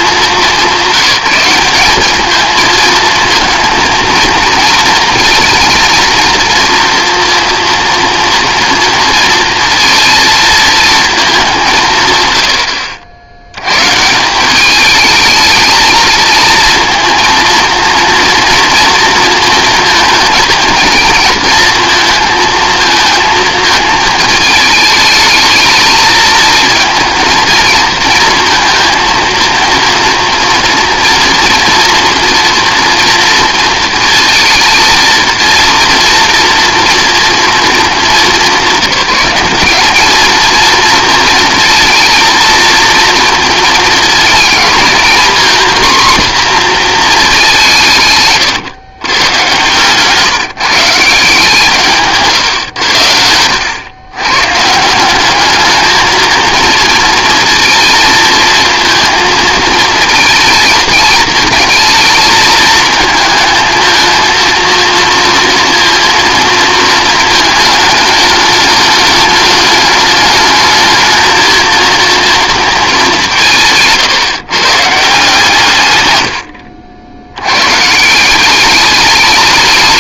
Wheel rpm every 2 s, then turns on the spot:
180, 220, 230, 230, 230, 230, 80, 200, 220, 230, 230, 230, 220, 230, 230, 240, 230, 230, 240, 180, 230, 220, 230, 240, 170, 160, 100, 160, 230, 230, 220, 220, 230, 230, 210, 220, 220, 150, 70, 200.
52-54